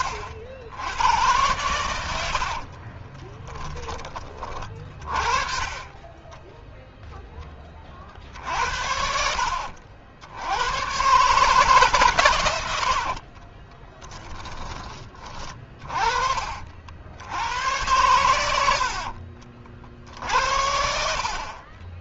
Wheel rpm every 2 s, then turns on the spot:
90, 70, 30, 20, 60, 80, 100, 20, 40, 100, 60.
2-4 14-16